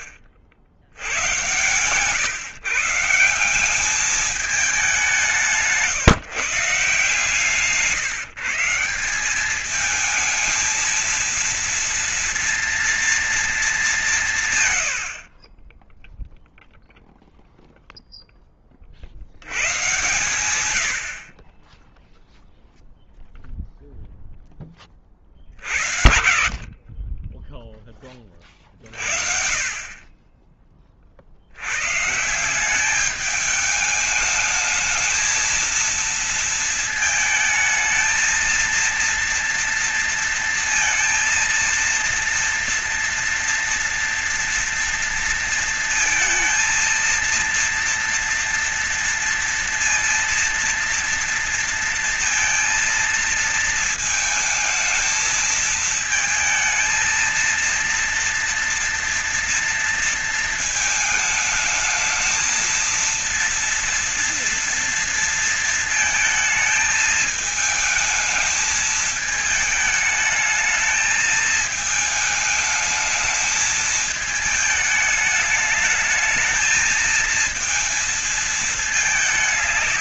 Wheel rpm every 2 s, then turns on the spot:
80, 130, 210, 150, 150, 220, 230, 150, 0, 10, 110, 0, 10, 60, 20, 30, 160, 220, 230, 220, 230, 230, 230, 230, 230, 230, 230, 220, 220, 230, 230, 220, 230, 220, 220, 220, 220, 220, 220, 230.
none